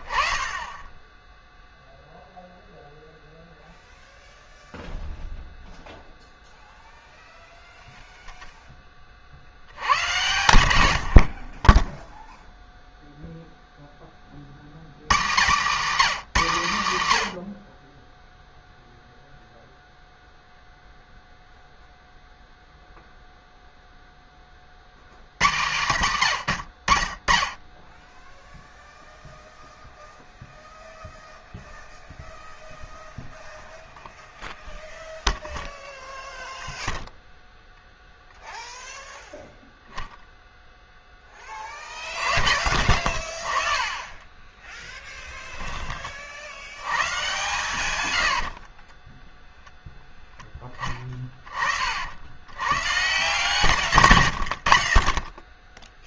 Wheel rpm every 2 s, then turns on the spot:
10, 0, 0, 0, 10, 90, 0, 90, 160, 0, 0, 0, 80, 40, 0, 0, 0, 0, 0, 0, 0, 60, 10, 80, 30, 20, 130, 40.
44-46 48-50